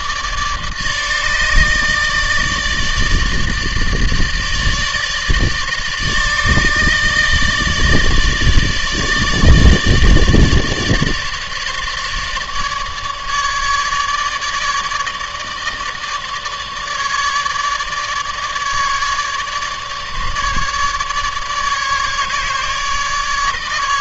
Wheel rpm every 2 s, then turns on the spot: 150, 150, 150, 150, 150, 150, 150, 150, 150, 150, 150, 150.
none